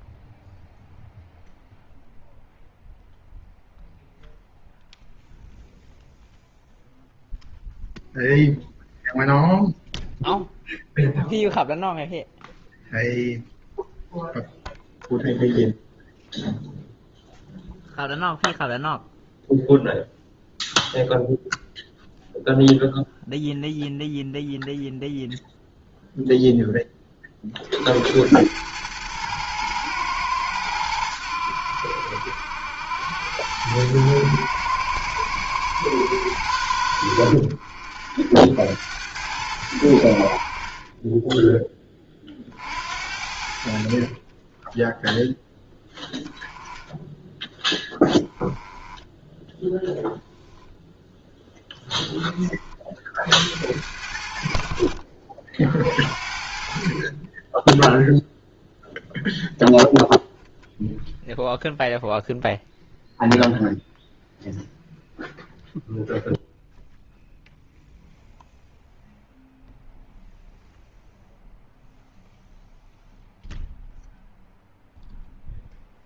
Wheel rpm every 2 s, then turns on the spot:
0, 0, 0, 0, 0, 0, 0, 0, 0, 0, 0, 0, 0, 10, 110, 100, 80, 110, 40, 70, 30, 60, 10, 10, 10, 0, 40, 50, 40, 0, 0, 0, 0, 0, 0, 0, 0, 0.
none